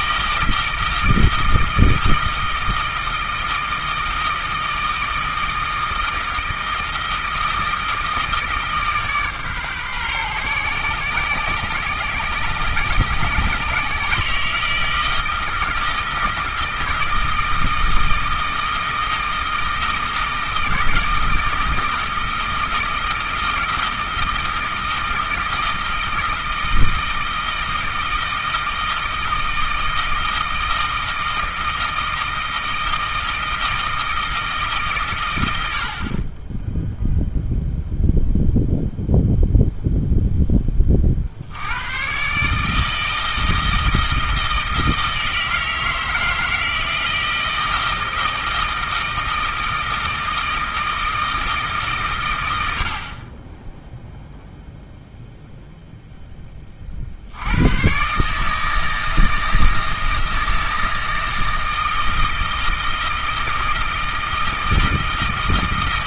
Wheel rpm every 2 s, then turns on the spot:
160, 160, 160, 160, 150, 120, 130, 160, 160, 160, 160, 160, 160, 160, 160, 160, 160, 140, 10, 0, 30, 160, 160, 160, 160, 160, 60, 0, 50, 160, 160, 160, 160.
none